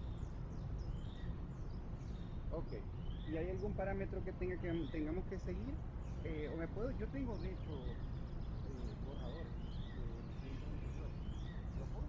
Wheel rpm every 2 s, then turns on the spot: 0, 0, 0, 0, 0, 0.
none